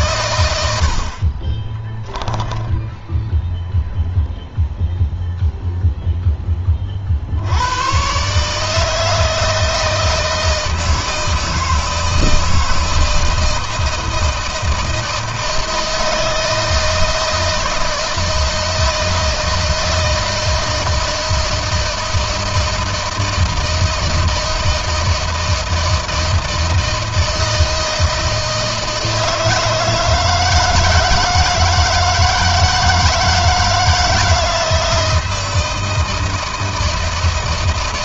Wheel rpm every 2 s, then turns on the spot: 80, 10, 0, 40, 160, 160, 160, 160, 160, 160, 160, 160, 170, 160, 160, 160, 160, 160, 160.
0-4